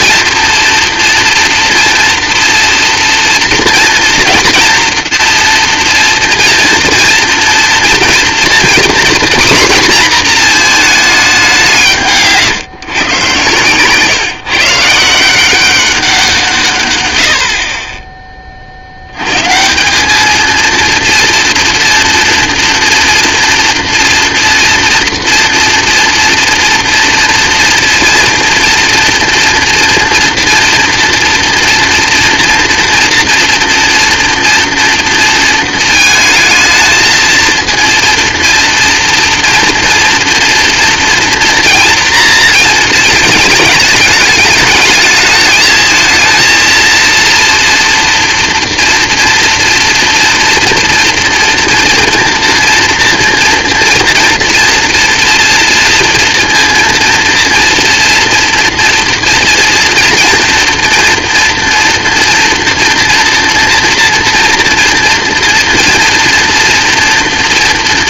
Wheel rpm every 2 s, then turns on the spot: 230, 230, 230, 230, 250, 220, 130, 160, 110, 80, 230, 230, 230, 230, 230, 230, 230, 230, 220, 230, 230, 220, 220, 230, 230, 230, 230, 230, 230, 230, 230, 240, 240, 240.
none